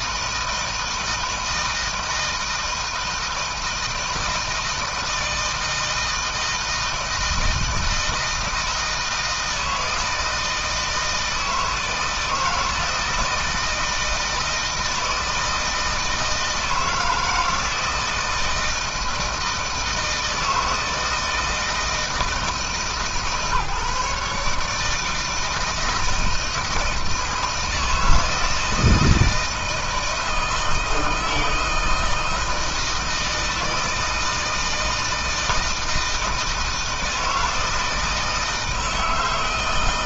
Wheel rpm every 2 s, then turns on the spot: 160, 160, 160, 160, 160, 160, 160, 160, 160, 160, 160, 150, 160, 160, 160, 160, 160, 160, 160, 160.
none